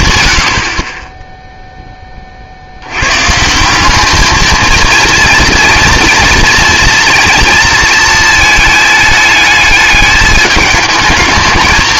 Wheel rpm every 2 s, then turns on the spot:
50, 70, 220, 230, 220, 210.
none